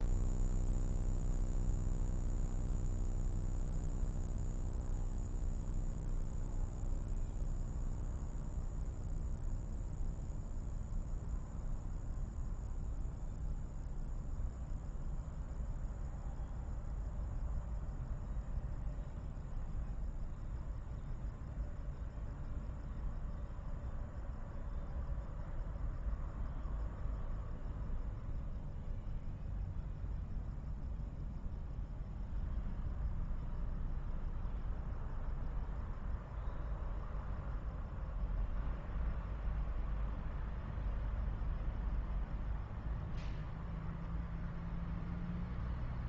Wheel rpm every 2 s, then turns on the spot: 0, 0, 0, 0, 0, 0, 0, 0, 0, 0, 0, 0, 0, 0, 0, 0, 0, 0, 0, 0, 0, 0, 0.
none